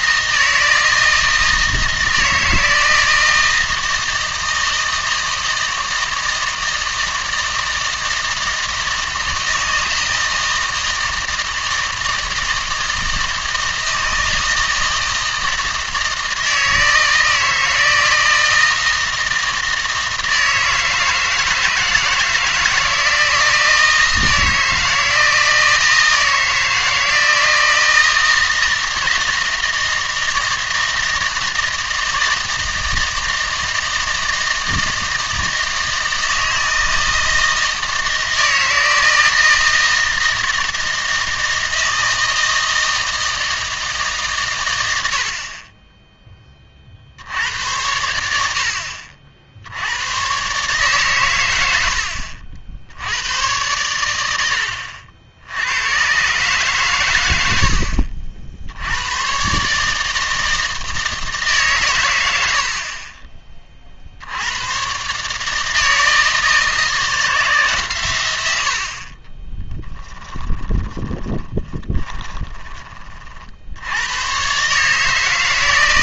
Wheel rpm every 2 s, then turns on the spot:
160, 160, 160, 160, 160, 160, 160, 160, 160, 160, 160, 160, 160, 160, 160, 160, 160, 160, 160, 160, 160, 160, 120, 40, 60, 140, 80, 80, 130, 80, 160, 70, 110, 160, 70, 20, 20, 130.
70-72